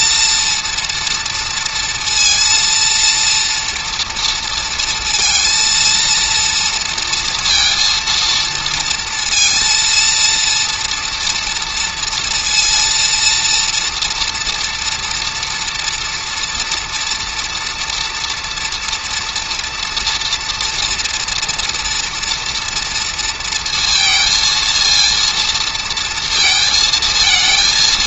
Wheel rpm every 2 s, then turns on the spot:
230, 230, 230, 230, 230, 230, 230, 230, 230, 230, 230, 230, 230, 220.
none